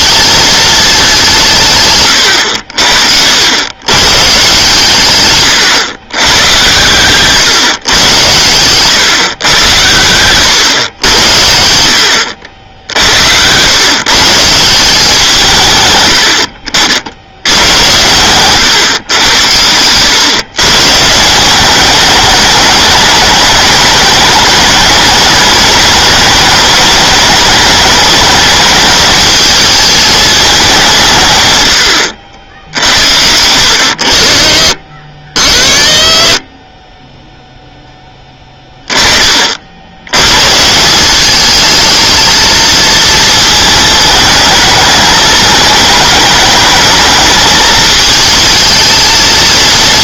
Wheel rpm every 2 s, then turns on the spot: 210, 70, 130, 120, 120, 100, 70, 170, 60, 130, 130, 210, 210, 210, 210, 200, 60, 50, 20, 10, 150, 220, 220, 220, 220.
12-14